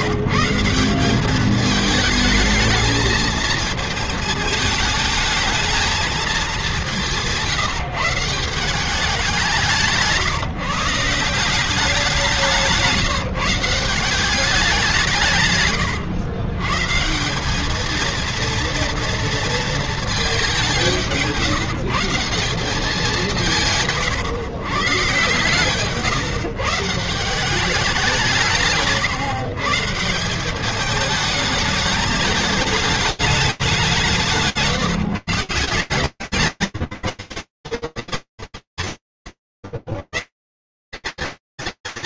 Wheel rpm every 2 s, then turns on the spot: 180, 220, 220, 190, 180, 160, 170, 180, 130, 230, 200, 190, 130, 150, 160, 200, 210, 170, 160, 200, 140.
none